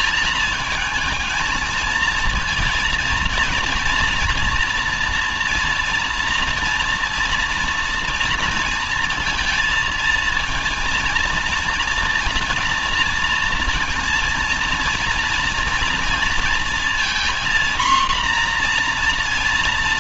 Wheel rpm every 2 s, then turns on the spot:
220, 230, 230, 230, 230, 230, 230, 230, 230, 240.
none